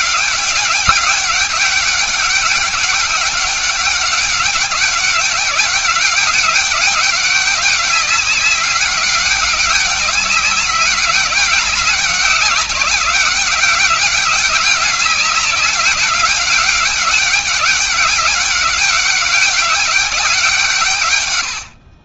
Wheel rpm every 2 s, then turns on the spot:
190, 200, 190, 200, 190, 200, 190, 200, 200, 200, 130.
none